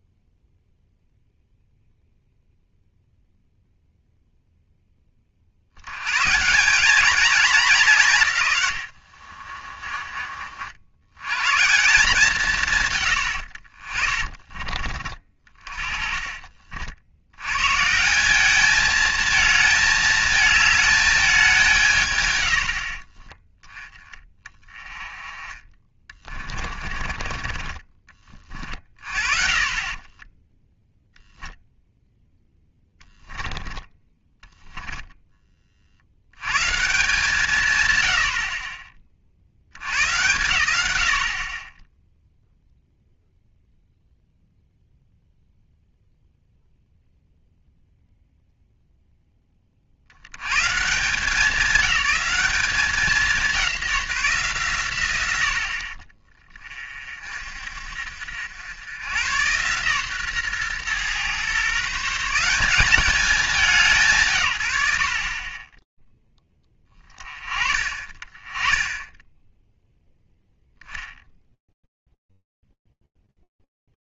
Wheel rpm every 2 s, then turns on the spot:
0, 0, 10, 200, 90, 80, 130, 40, 70, 220, 220, 40, 20, 30, 40, 0, 0, 0, 140, 30, 90, 0, 0, 0, 0, 120, 190, 130, 30, 90, 120, 190, 70, 30, 10, 10, 10.
8-10 26-28